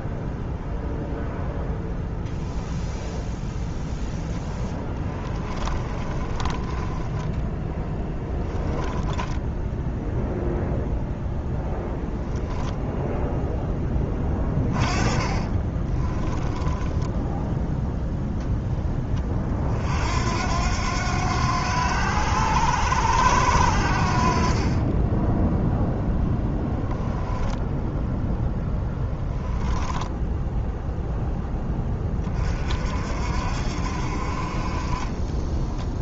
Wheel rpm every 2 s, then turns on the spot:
0, 0, 20, 20, 10, 0, 0, 30, 10, 10, 90, 90, 20, 10, 0, 0, 50, 30.
4-10 14-18 24-26